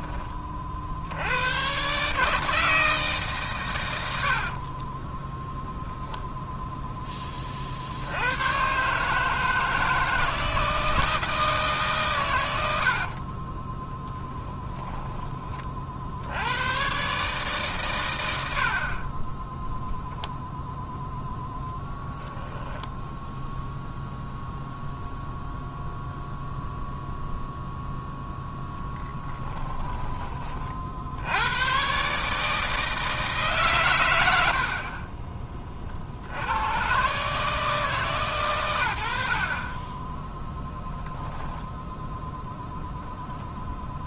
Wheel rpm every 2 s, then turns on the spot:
50, 160, 30, 10, 120, 160, 70, 10, 120, 60, 0, 0, 0, 0, 0, 50, 160, 60, 110, 100, 0, 0.
4-6 12-14 34-36